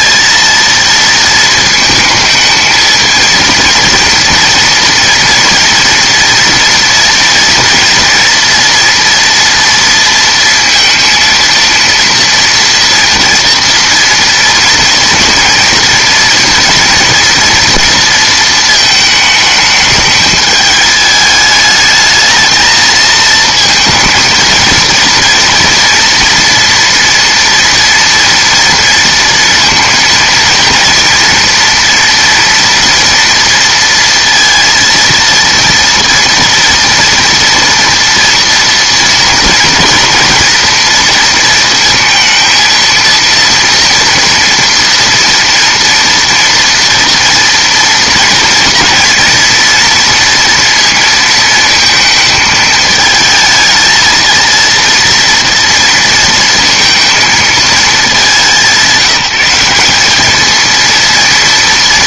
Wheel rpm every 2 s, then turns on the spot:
230, 220, 230, 230, 230, 230, 230, 230, 230, 220, 210, 220, 220, 230, 240, 230, 230, 230, 230, 230, 230, 230, 230, 230, 230, 230, 220, 230, 230, 180, 220.
none